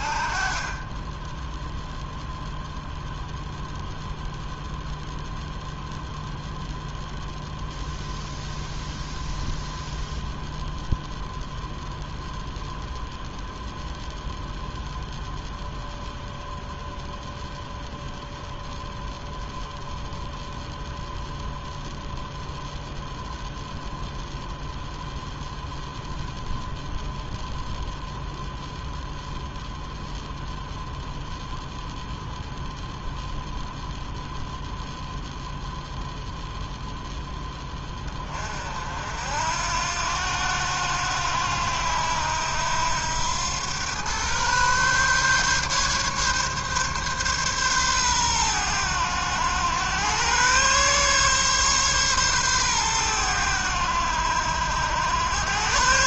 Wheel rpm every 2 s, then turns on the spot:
10, 0, 0, 0, 0, 0, 0, 0, 0, 0, 0, 0, 0, 0, 0, 0, 0, 0, 0, 60, 80, 90, 140, 140, 100, 130, 110, 90.
0-2